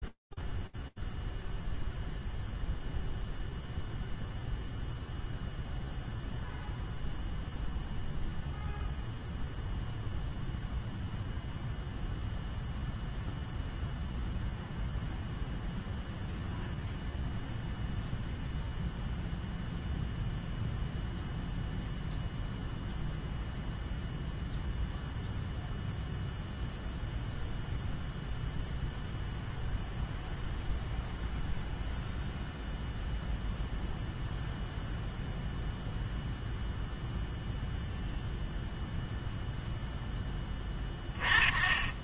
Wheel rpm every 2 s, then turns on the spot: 0, 0, 0, 0, 0, 0, 0, 0, 0, 0, 0, 0, 0, 0, 0, 0, 0, 0, 0, 20, 10.
none